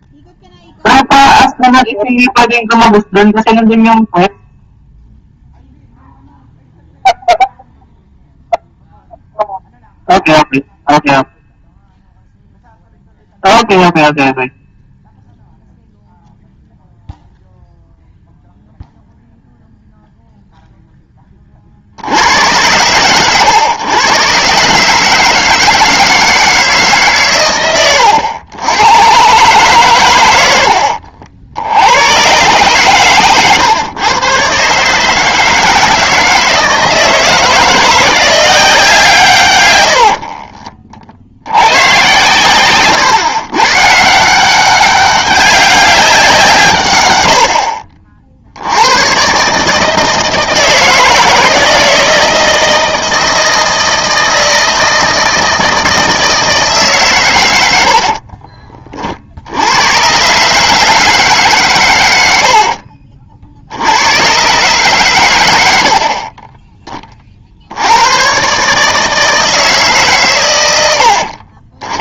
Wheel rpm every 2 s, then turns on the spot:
0, 0, 0, 0, 0, 0, 0, 0, 0, 0, 0, 100, 140, 150, 90, 70, 130, 140, 160, 180, 40, 130, 190, 120, 80, 160, 160, 160, 150, 40, 150, 60, 130, 20, 140, 100.
40-42 62-64